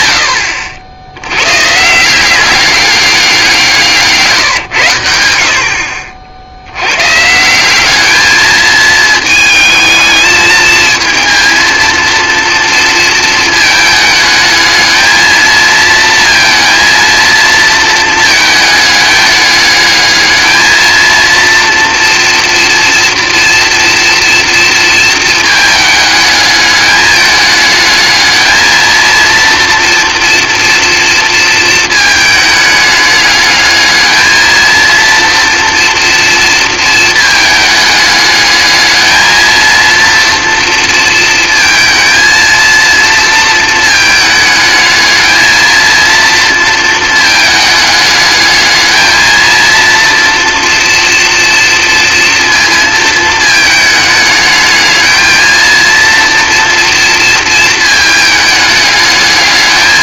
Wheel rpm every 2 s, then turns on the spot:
80, 190, 150, 70, 220, 220, 230, 220, 230, 220, 220, 230, 230, 210, 220, 230, 210, 220, 230, 210, 230, 230, 220, 230, 210, 230, 230, 220, 230, 210.
none